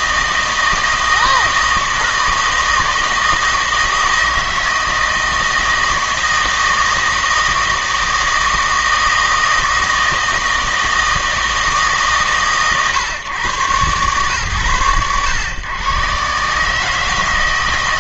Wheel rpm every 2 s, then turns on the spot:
160, 160, 160, 160, 160, 160, 110, 100, 150.
none